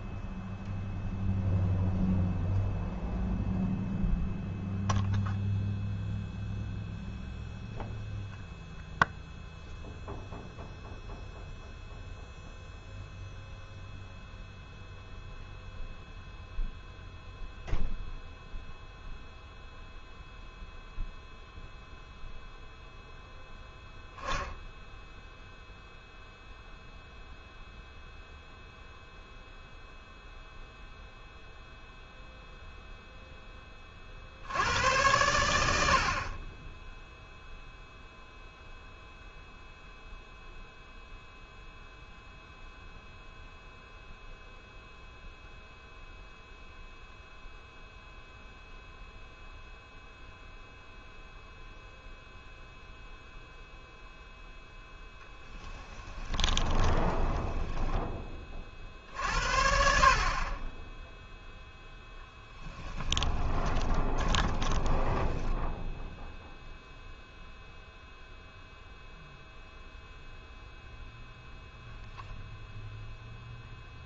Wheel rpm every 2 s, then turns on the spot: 0, 0, 0, 0, 0, 0, 0, 0, 0, 0, 0, 0, 0, 0, 0, 0, 0, 100, 10, 0, 0, 0, 0, 0, 0, 0, 0, 0, 20, 40, 10, 20, 20, 0, 0, 0, 0.
56-58 62-66